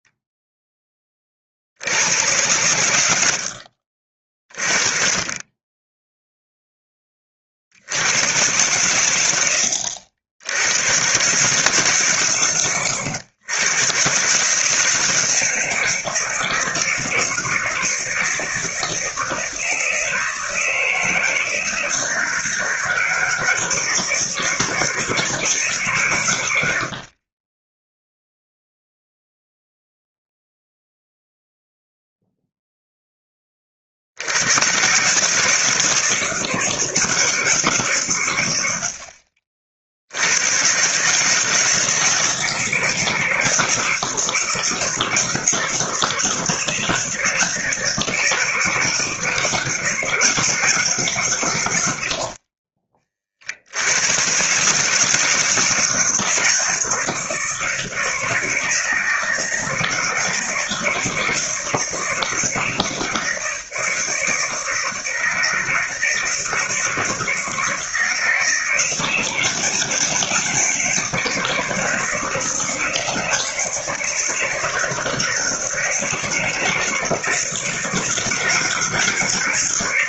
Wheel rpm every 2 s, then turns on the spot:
20, 100, 30, 10, 110, 120, 110, 150, 160, 160, 160, 160, 160, 70, 0, 0, 0, 140, 170, 80, 130, 160, 160, 160, 160, 150, 30, 150, 160, 160, 160, 160, 160, 160, 160, 150, 160, 160, 160, 150.
none